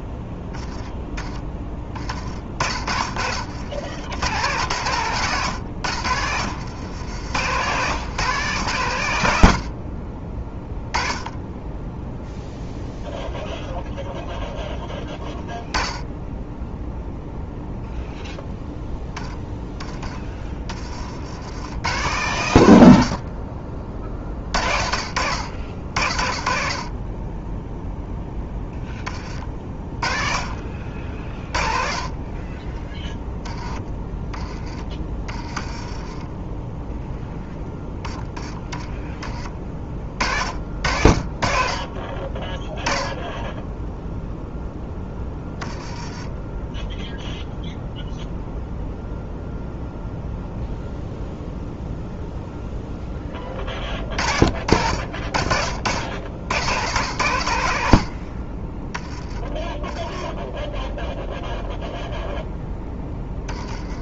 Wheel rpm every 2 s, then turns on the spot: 20, 40, 100, 80, 140, 10, 0, 0, 10, 0, 30, 110, 40, 40, 10, 50, 20, 30, 10, 10, 50, 10, 0, 10, 0, 0, 0, 50, 60, 30, 10, 10.
2-4 6-8 34-36